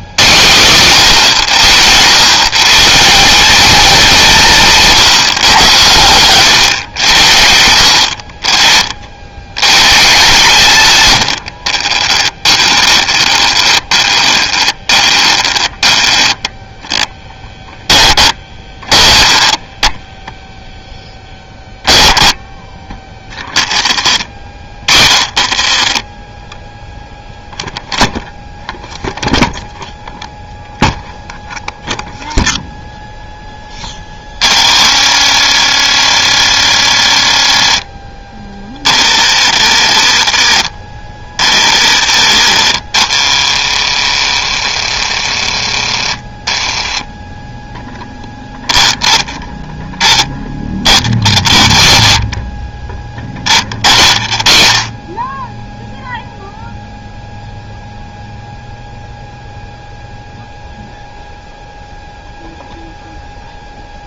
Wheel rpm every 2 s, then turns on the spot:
130, 170, 170, 100, 50, 110, 20, 20, 10, 20, 10, 20, 40, 0, 0, 0, 0, 60, 60, 40, 40, 60, 70, 30, 0, 10, 10, 20, 0, 0, 0, 0.
12-20 22-26 34-48 50-52